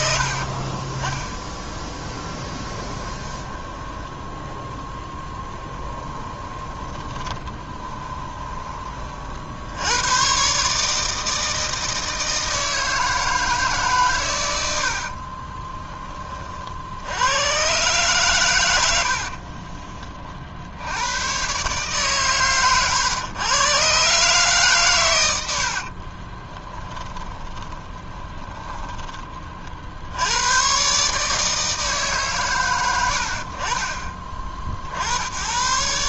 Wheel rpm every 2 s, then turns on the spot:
30, 20, 10, 20, 30, 150, 160, 70, 60, 90, 80, 120, 130, 20, 20, 120, 120, 50.
2-4 6-8 14-16 26-28